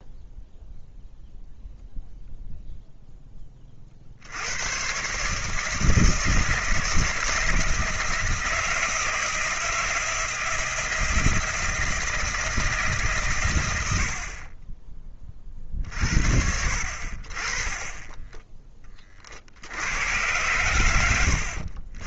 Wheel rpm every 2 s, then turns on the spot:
0, 0, 100, 160, 160, 160, 150, 20, 60, 20, 100.
none